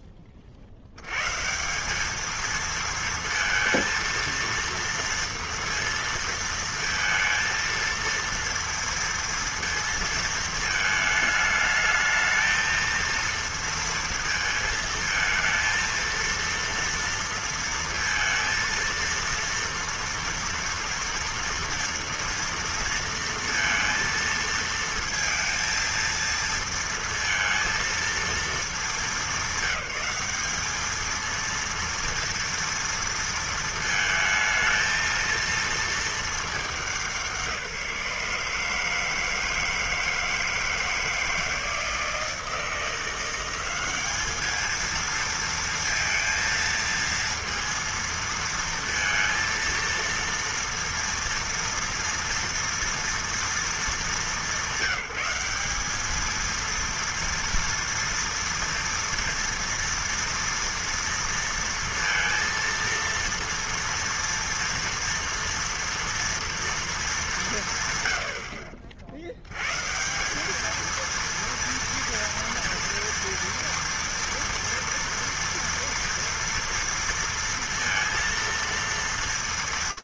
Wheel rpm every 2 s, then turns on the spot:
60, 220, 230, 230, 230, 220, 230, 220, 230, 230, 230, 230, 230, 230, 190, 230, 230, 230, 180, 160, 160, 170, 220, 230, 230, 230, 230, 190, 230, 230, 230, 230, 230, 230, 70, 220, 230, 230, 230, 230.
none